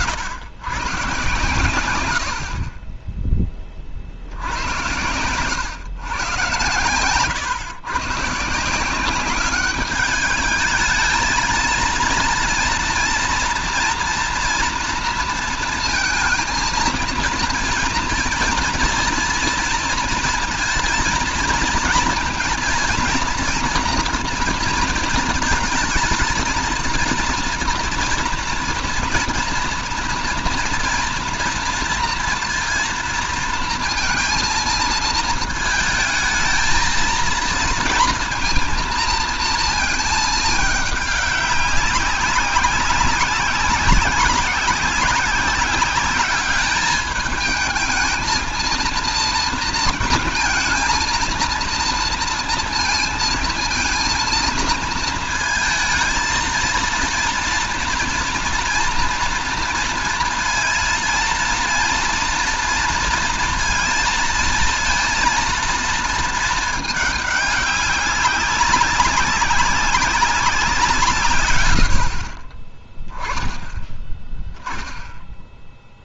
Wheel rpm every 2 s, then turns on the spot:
120, 60, 80, 120, 160, 220, 230, 230, 230, 230, 230, 240, 230, 230, 240, 240, 230, 230, 220, 230, 220, 190, 190, 210, 230, 230, 230, 230, 220, 230, 230, 230, 230, 220, 190, 190, 50, 10.
none